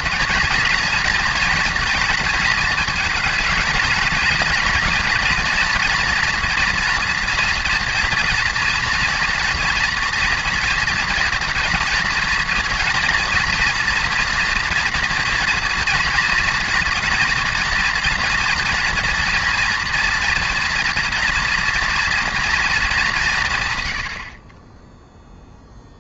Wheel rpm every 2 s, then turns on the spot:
240, 230, 240, 230, 230, 230, 230, 230, 240, 230, 230, 210, 10.
none